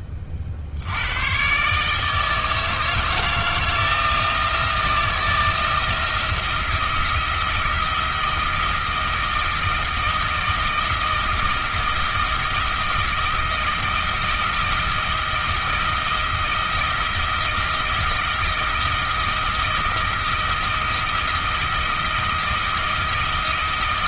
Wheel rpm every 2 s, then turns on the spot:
70, 160, 170, 170, 170, 170, 160, 160, 160, 170, 160, 160.
none